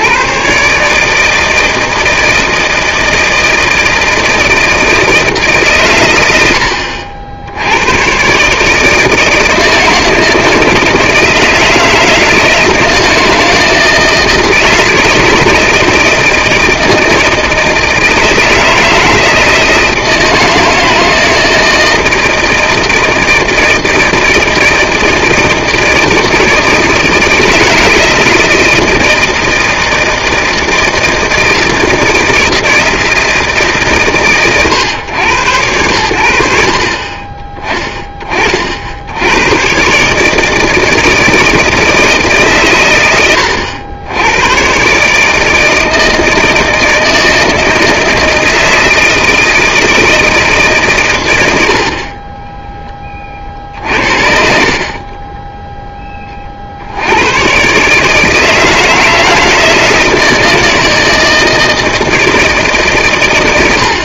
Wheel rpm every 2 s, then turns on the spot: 150, 160, 160, 70, 150, 160, 160, 160, 160, 160, 160, 160, 160, 160, 160, 160, 160, 120, 60, 50, 160, 120, 120, 160, 160, 140, 10, 50, 50, 160, 160, 150.
54-56